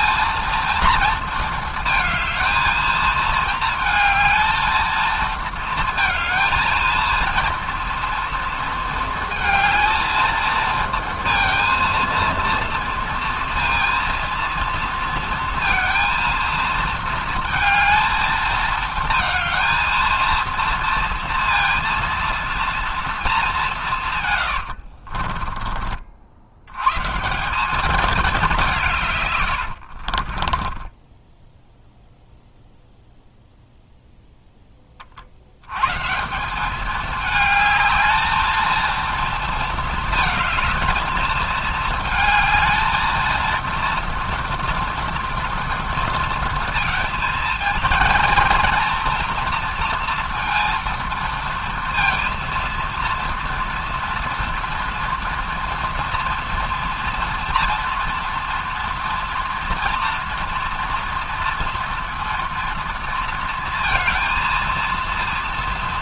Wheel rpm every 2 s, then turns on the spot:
230, 220, 220, 230, 230, 230, 230, 230, 230, 220, 230, 230, 120, 90, 190, 20, 0, 10, 190, 220, 220, 220, 230, 230, 230, 230, 230, 230, 230, 240, 240, 230, 230.
24-26 30-32